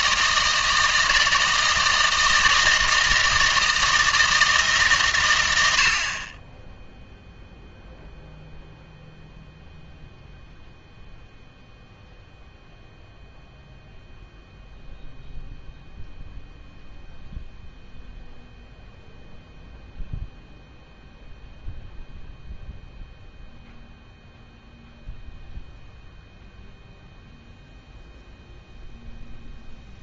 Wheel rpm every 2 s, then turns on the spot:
160, 160, 150, 10, 0, 0, 0, 0, 0, 0, 0, 0, 0, 0, 0.
none